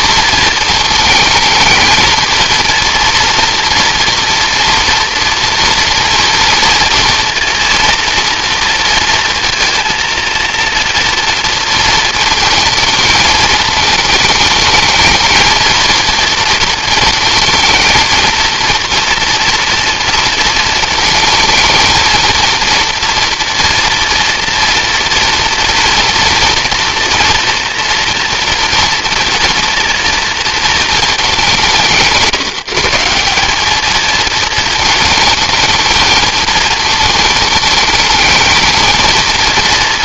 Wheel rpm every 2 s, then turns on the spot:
220, 230, 230, 230, 230, 230, 220, 220, 230, 230, 230, 230, 240, 230, 230, 230, 170, 220, 220, 220.
none